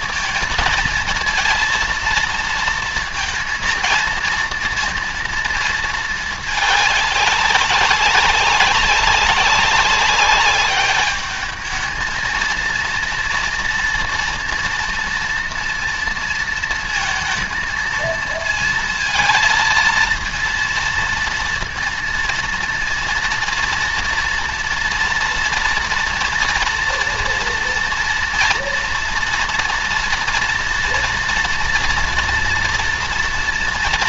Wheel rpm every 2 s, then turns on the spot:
230, 230, 230, 200, 190, 200, 230, 230, 230, 230, 230, 230, 230, 230, 230, 230, 230.
none